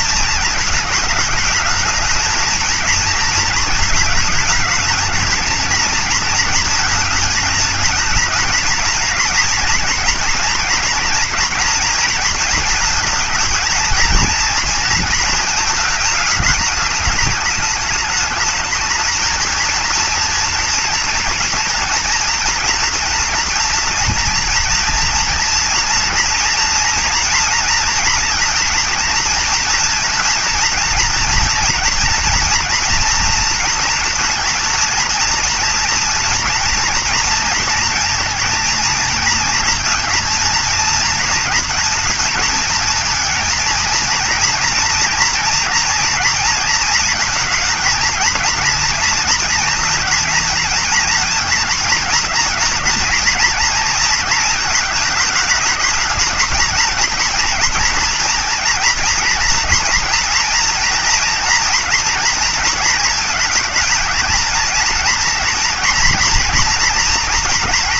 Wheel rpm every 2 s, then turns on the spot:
220, 220, 220, 230, 230, 230, 230, 230, 210, 220, 230, 230, 230, 230, 240, 230, 240, 230, 230, 230, 230, 230, 230, 230, 230, 230, 230, 230, 220, 240, 230, 230, 230, 240.
none